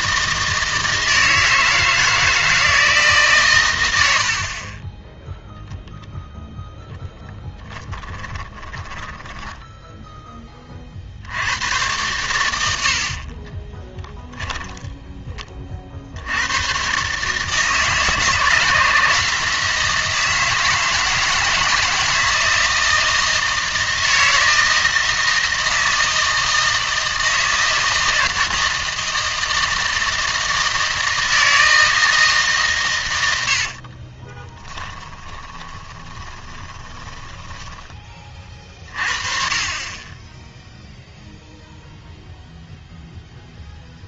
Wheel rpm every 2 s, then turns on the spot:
160, 160, 50, 0, 20, 20, 90, 10, 100, 160, 160, 160, 160, 160, 160, 160, 150, 20, 30, 30, 0, 0.
8-10 34-38